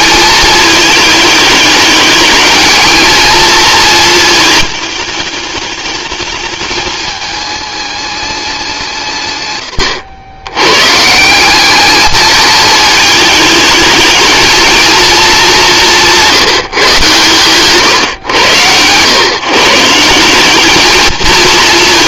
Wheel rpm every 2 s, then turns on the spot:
220, 220, 210, 210, 160, 140, 220, 230, 150, 110, 210.
none